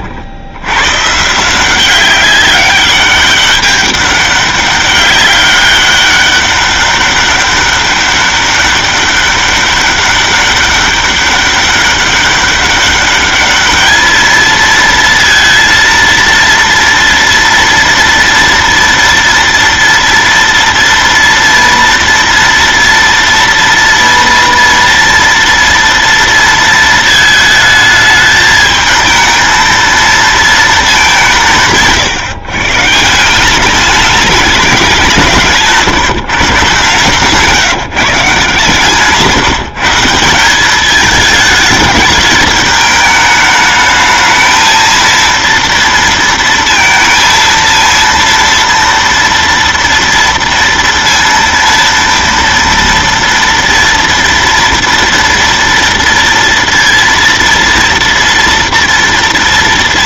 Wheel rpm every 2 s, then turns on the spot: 100, 190, 200, 200, 200, 200, 200, 220, 230, 240, 230, 230, 230, 230, 220, 220, 150, 200, 140, 150, 200, 210, 220, 230, 230, 230, 230, 230, 230, 240.
none